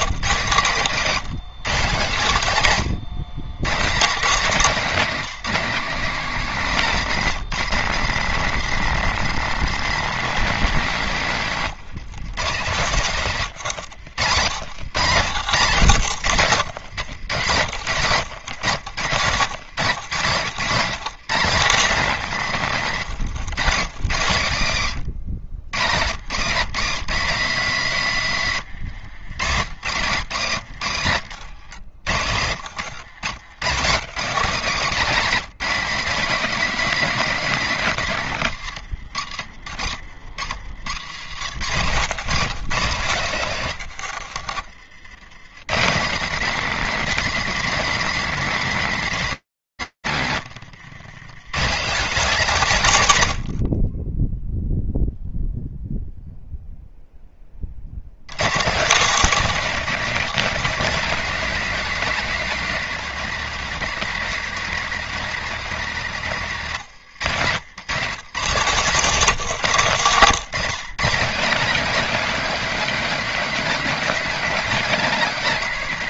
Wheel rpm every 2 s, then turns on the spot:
180, 150, 200, 170, 190, 130, 130, 130, 110, 130, 170, 130, 110, 180, 100, 110, 100, 190, 220, 100, 120, 150, 90, 210, 130, 170, 60, 0, 70, 250, 260, 230, 200, 170, 170, 250, 250, 230.
10-12 14-18 28-30 32-34 38-42